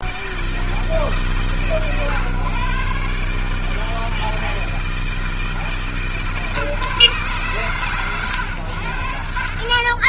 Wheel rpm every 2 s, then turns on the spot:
160, 130, 160, 140, 80.
none